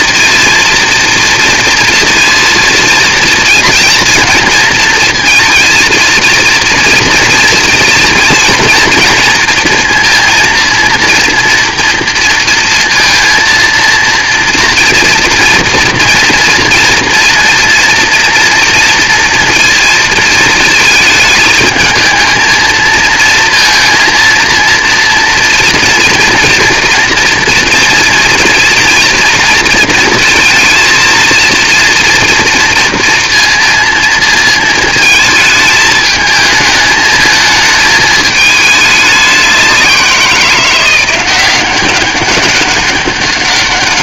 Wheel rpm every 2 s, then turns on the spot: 230, 230, 230, 230, 230, 230, 230, 230, 230, 230, 220, 220, 230, 230, 240, 230, 230, 230, 220, 210, 170, 190.
none